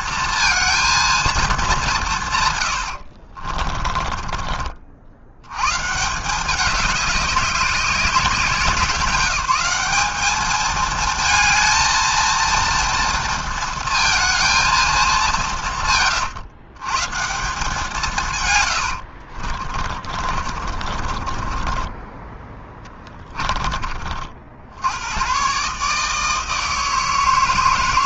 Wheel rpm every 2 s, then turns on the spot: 230, 140, 60, 200, 190, 220, 230, 220, 110, 120, 50, 20, 80, 160.
18-24